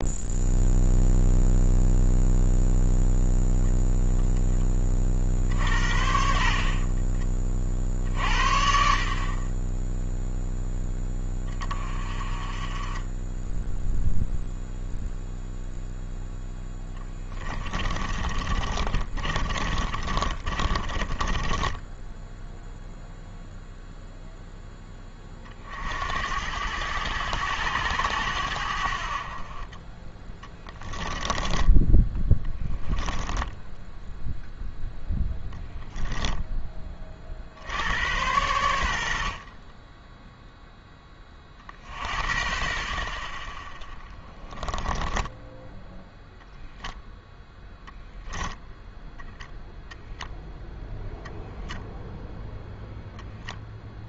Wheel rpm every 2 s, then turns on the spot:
0, 0, 30, 40, 60, 10, 20, 0, 10, 30, 30, 0, 10, 100, 70, 20, 10, 0, 20, 90, 10, 40, 10, 0, 0, 0, 0.
16-22 30-34 44-46